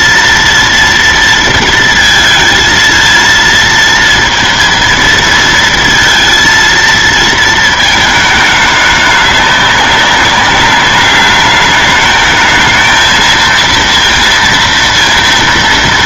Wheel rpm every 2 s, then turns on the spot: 230, 230, 230, 230, 210, 200, 220, 230.
none